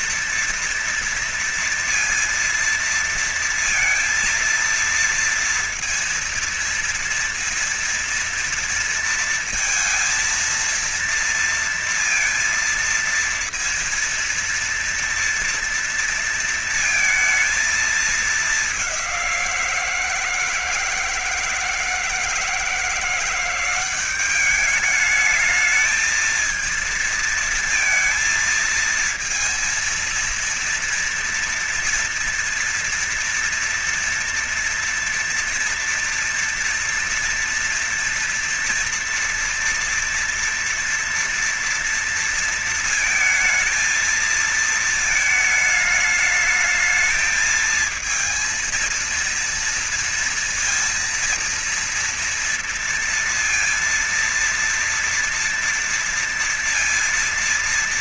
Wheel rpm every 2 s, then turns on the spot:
230, 230, 230, 230, 230, 230, 230, 230, 230, 210, 170, 170, 190, 220, 230, 230, 230, 230, 230, 240, 230, 230, 220, 210, 230, 230, 230, 230, 230.
none